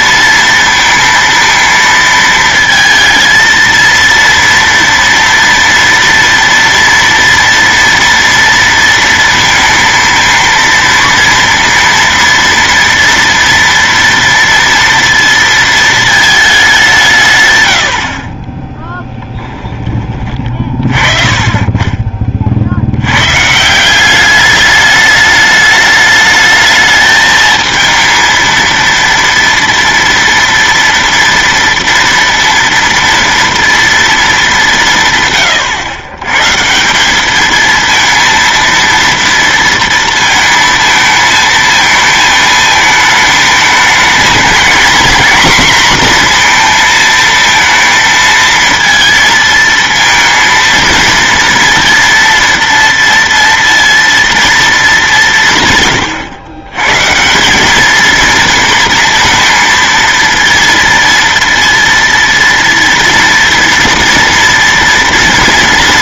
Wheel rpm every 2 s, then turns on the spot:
230, 230, 230, 230, 230, 230, 230, 230, 160, 10, 30, 80, 210, 220, 230, 230, 230, 150, 190, 230, 220, 220, 230, 230, 230, 230, 230, 210, 130, 230, 230, 230, 230.
none